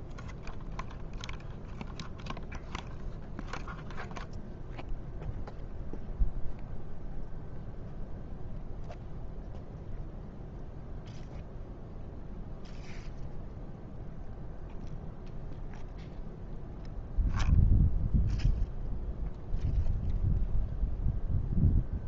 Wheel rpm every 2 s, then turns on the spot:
0, 0, 0, 0, 0, 0, 0, 0, 0, 0, 0.
none